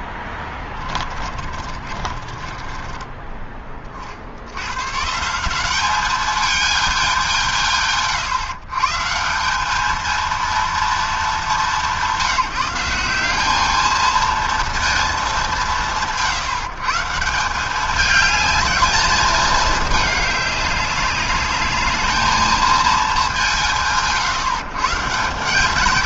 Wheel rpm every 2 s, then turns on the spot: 10, 30, 40, 200, 130, 210, 190, 210, 130, 180, 210, 200, 130.
0-4